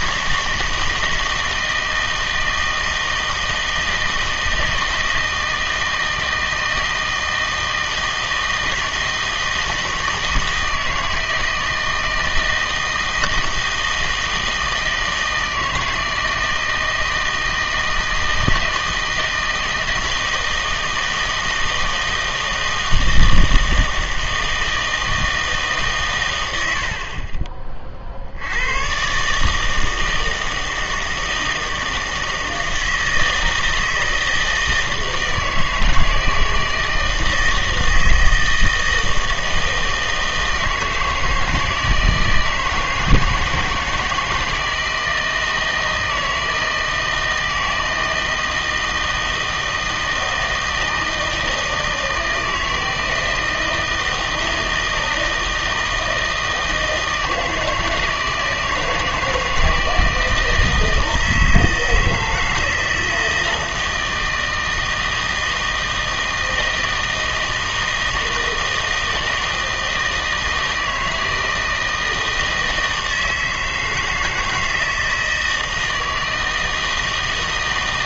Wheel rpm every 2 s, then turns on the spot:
160, 160, 160, 160, 160, 160, 160, 160, 160, 160, 160, 160, 160, 80, 90, 160, 160, 160, 160, 160, 160, 160, 160, 160, 160, 160, 160, 160, 160, 160, 160, 160, 160, 160, 160, 160, 160, 160, 160.
none